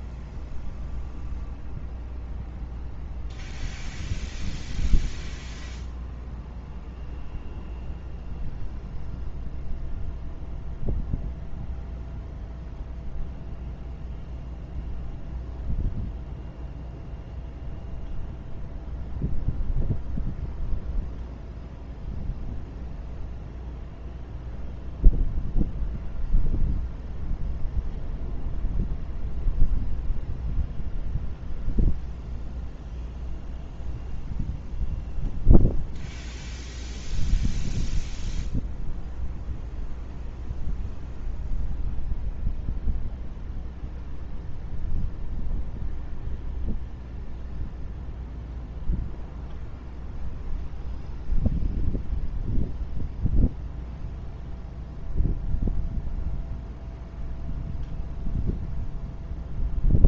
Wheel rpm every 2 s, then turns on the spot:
0, 0, 0, 0, 0, 0, 0, 0, 0, 0, 0, 0, 0, 0, 0, 0, 0, 0, 0, 0, 0, 0, 0, 0, 0, 0, 0, 0, 0, 0.
none